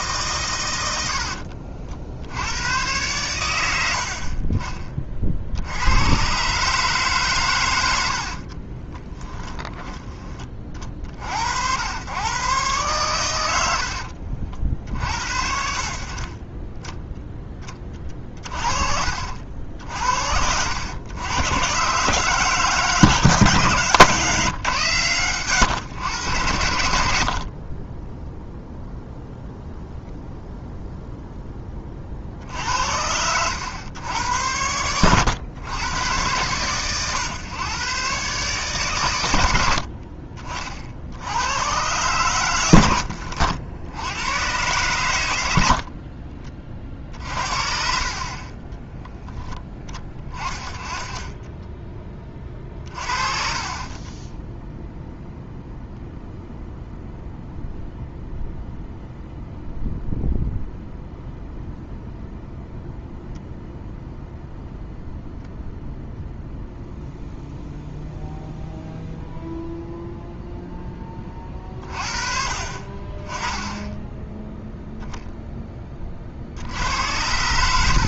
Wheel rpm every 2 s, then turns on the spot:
90, 100, 40, 140, 40, 40, 120, 50, 20, 40, 90, 140, 130, 80, 0, 0, 80, 100, 120, 130, 60, 90, 120, 30, 20, 30, 40, 0, 0, 0, 0, 0, 0, 0, 0, 0, 40, 0, 80.
0-2 8-10 52-54